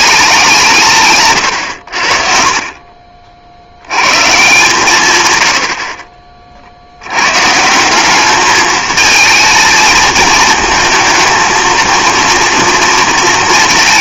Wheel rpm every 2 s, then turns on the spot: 130, 60, 110, 130, 220, 220, 230.
none